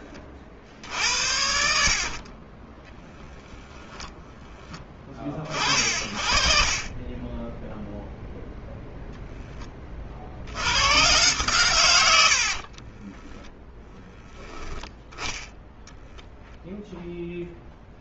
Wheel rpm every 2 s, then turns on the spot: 40, 20, 30, 10, 0, 130, 10, 10, 0.
2-4 6-8 12-14